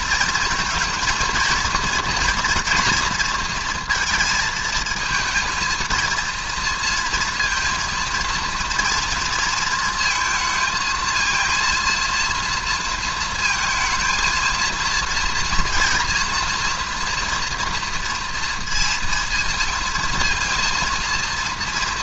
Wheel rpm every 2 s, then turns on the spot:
220, 230, 220, 230, 230, 230, 230, 230, 240, 230, 230.
none